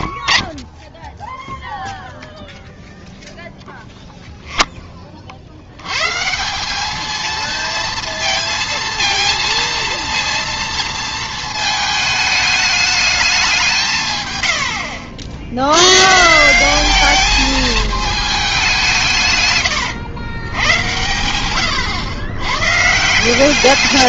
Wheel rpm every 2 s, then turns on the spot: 70, 0, 10, 190, 230, 230, 210, 100, 190, 190, 100, 130.
none